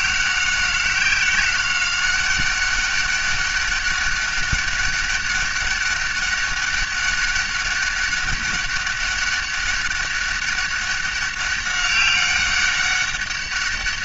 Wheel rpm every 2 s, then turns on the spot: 190, 200, 200, 200, 200, 200, 200.
none